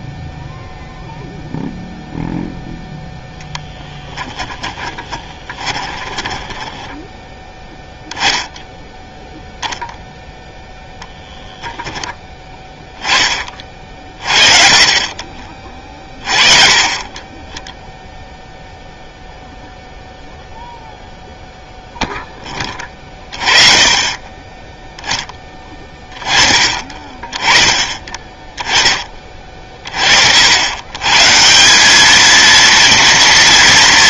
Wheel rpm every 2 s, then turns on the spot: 0, 0, 20, 10, 10, 0, 10, 40, 30, 0, 0, 20, 10, 30, 10, 80, 230.
4-8